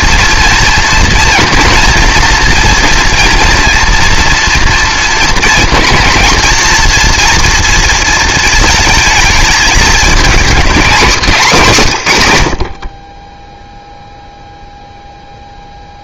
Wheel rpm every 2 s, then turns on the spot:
240, 230, 230, 230, 220, 230, 70, 0.
none